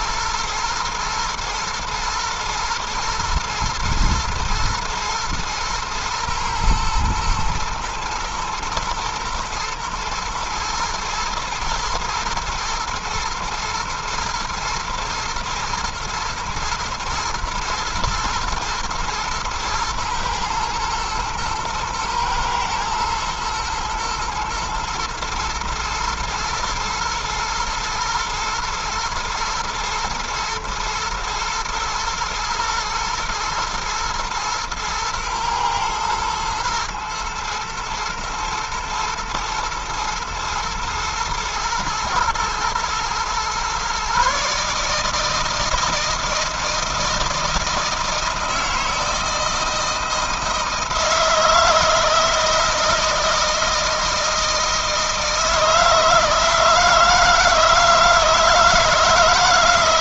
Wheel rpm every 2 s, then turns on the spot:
120, 120, 120, 110, 110, 110, 110, 110, 110, 110, 110, 120, 120, 110, 120, 110, 120, 120, 120, 110, 120, 120, 150, 160, 160, 160, 160, 160, 160, 160.
none